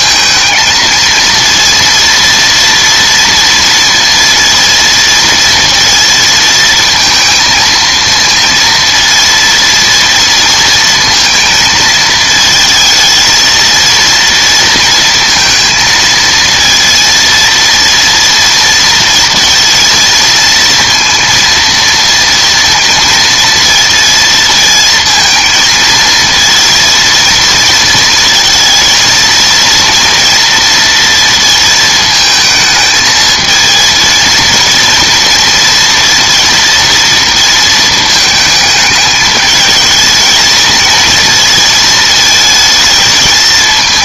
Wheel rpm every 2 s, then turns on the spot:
220, 230, 230, 230, 230, 230, 220, 230, 230, 230, 230, 230, 230, 220, 230, 230, 220, 230, 230, 220, 230, 220.
none